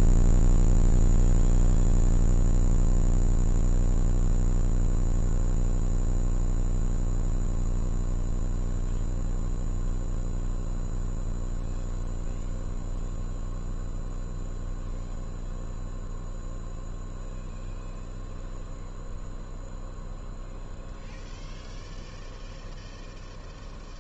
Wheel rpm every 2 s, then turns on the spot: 0, 0, 0, 0, 0, 0, 0, 0, 0, 0, 0, 0.
none